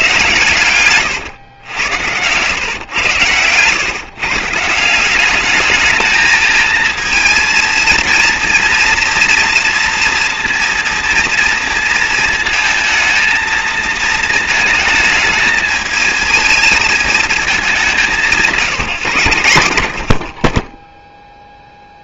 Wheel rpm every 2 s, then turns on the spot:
120, 120, 160, 220, 230, 230, 230, 230, 220, 180, 30.
none